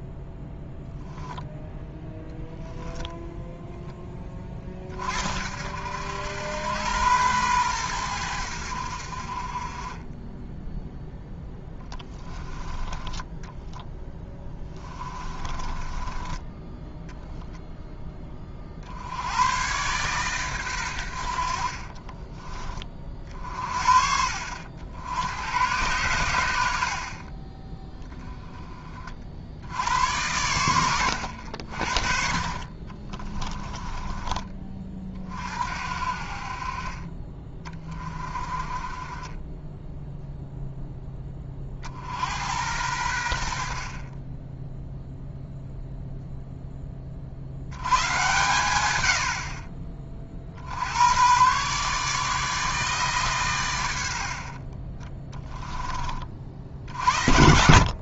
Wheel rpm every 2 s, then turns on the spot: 0, 0, 40, 100, 60, 0, 10, 20, 10, 60, 110, 40, 70, 60, 30, 100, 30, 30, 30, 30, 10, 90, 0, 20, 110, 80, 150, 30, 60.
14-16 32-34